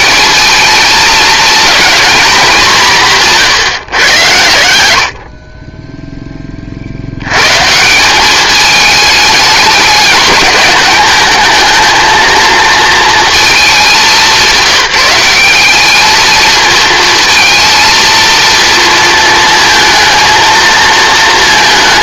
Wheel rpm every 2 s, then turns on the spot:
220, 200, 80, 50, 210, 210, 230, 190, 230, 230, 230.
none